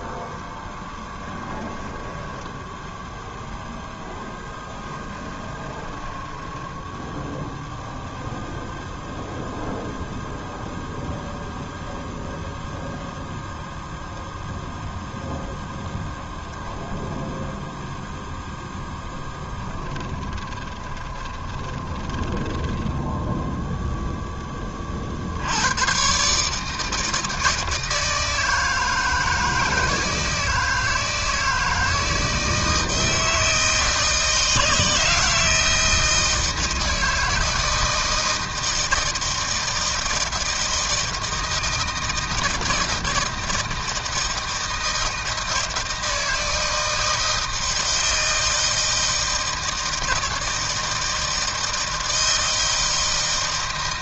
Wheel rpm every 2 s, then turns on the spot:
10, 10, 10, 10, 0, 0, 0, 0, 0, 0, 20, 30, 10, 140, 160, 160, 160, 160, 160, 160, 160, 160, 160, 160, 160, 160, 160.
2-8 20-24